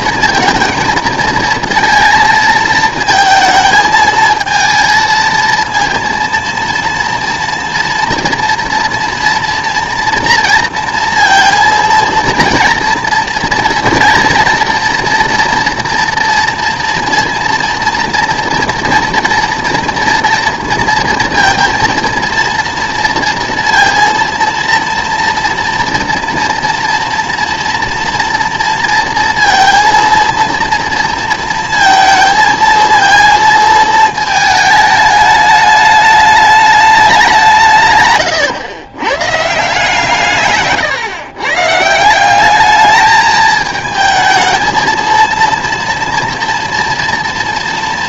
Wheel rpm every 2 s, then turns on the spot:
230, 220, 220, 230, 230, 230, 230, 230, 230, 230, 230, 230, 230, 230, 230, 230, 230, 220, 210, 110, 140, 200, 220, 230.
none